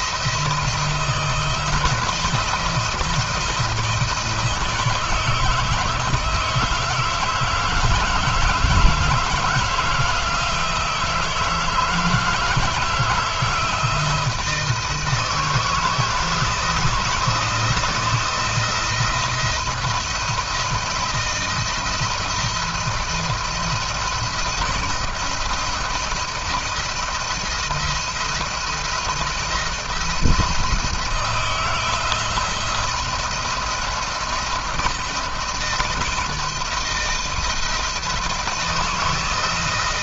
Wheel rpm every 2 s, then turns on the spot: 170, 160, 160, 160, 160, 170, 170, 160, 160, 170, 170, 170, 170, 170, 170, 170, 170, 160, 160, 170.
none